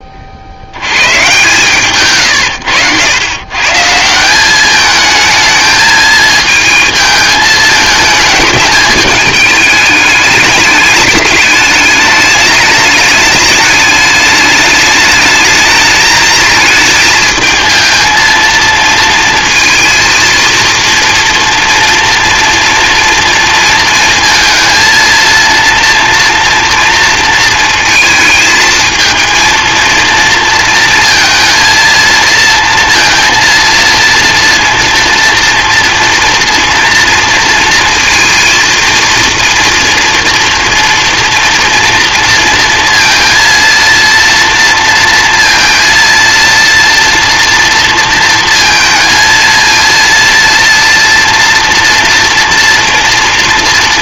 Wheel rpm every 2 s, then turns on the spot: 120, 110, 220, 220, 210, 210, 220, 210, 220, 230, 230, 230, 230, 230, 220, 230, 230, 230, 230, 230, 230, 230, 230, 240, 230, 230, 230.
none